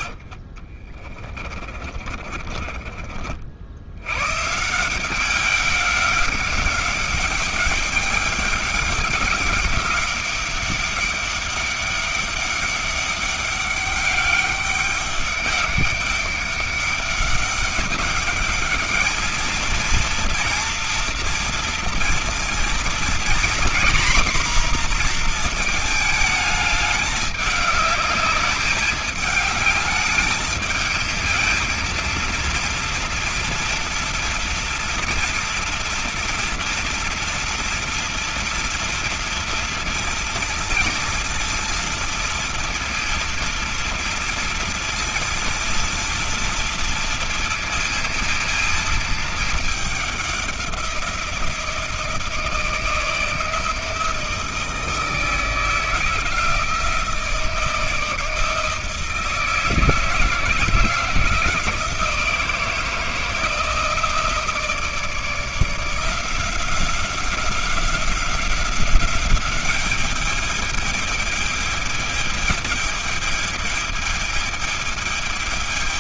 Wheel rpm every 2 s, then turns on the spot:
40, 30, 150, 200, 200, 200, 200, 200, 200, 210, 230, 230, 250, 210, 210, 220, 230, 230, 230, 230, 230, 230, 230, 230, 230, 190, 160, 160, 160, 160, 160, 160, 160, 180, 190, 210, 220, 220.
0-4